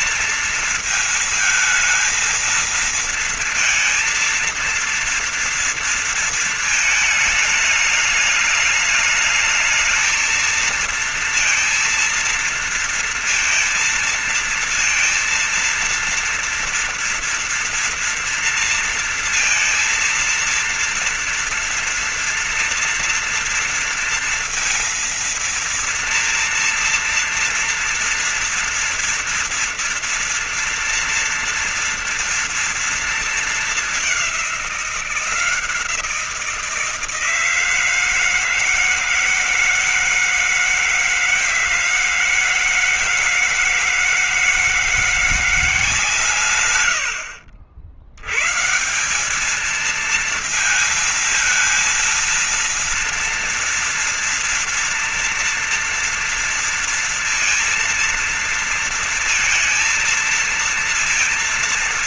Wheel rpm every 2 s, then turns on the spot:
230, 220, 230, 230, 210, 220, 230, 230, 230, 230, 230, 230, 230, 230, 230, 230, 240, 210, 170, 160, 160, 160, 160, 150, 80, 220, 230, 230, 230, 230, 230.
none